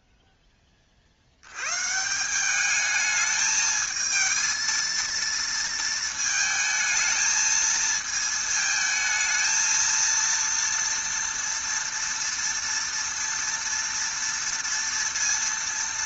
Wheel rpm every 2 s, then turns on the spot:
20, 200, 230, 220, 220, 230, 230, 230.
none